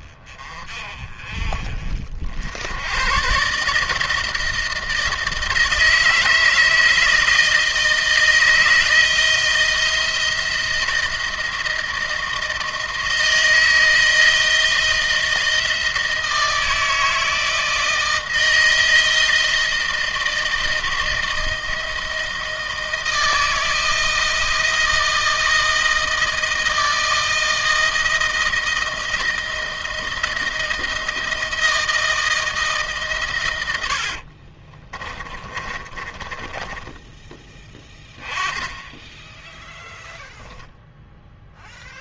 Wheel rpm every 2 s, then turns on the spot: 30, 100, 160, 160, 160, 160, 160, 170, 160, 160, 160, 160, 160, 160, 160, 160, 140, 30, 20, 10, 10.
34-38